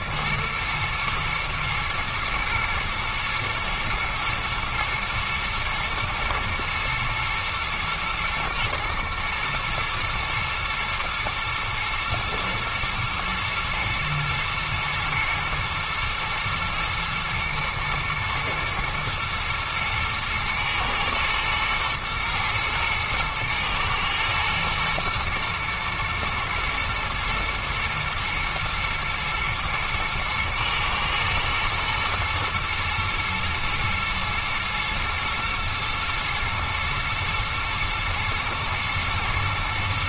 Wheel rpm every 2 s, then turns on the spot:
120, 110, 120, 110, 110, 110, 120, 120, 120, 120, 110, 120, 120, 120, 110, 120, 110, 110, 110, 120.
none